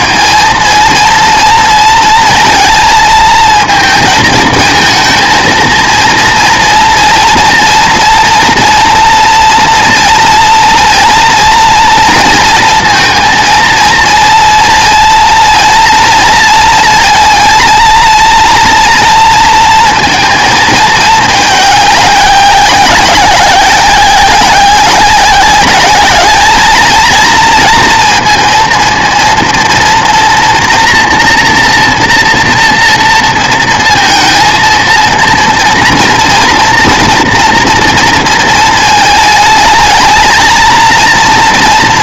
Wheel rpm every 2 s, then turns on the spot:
230, 230, 220, 230, 230, 230, 230, 230, 230, 230, 220, 190, 190, 210, 230, 230, 230, 230, 240, 220, 220.
none